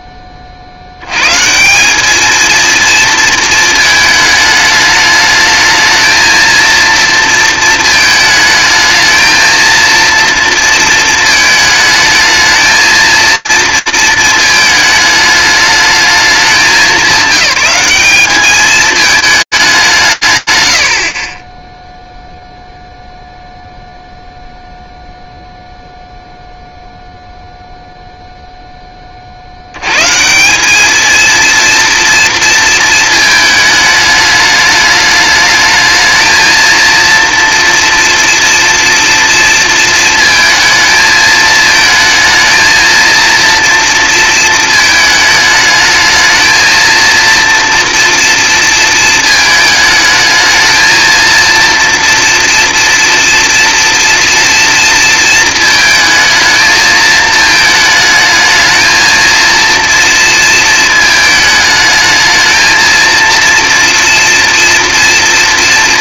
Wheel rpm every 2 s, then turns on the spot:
120, 230, 210, 230, 220, 230, 230, 220, 190, 210, 90, 0, 0, 0, 70, 230, 220, 220, 230, 230, 220, 230, 220, 230, 220, 230, 230, 220, 220, 230, 220, 230, 230.
none